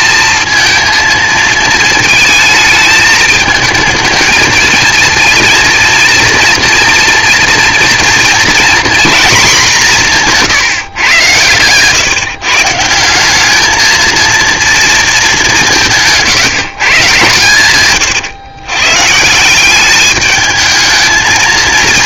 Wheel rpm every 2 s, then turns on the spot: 230, 220, 220, 230, 230, 170, 150, 230, 150, 120, 210.
none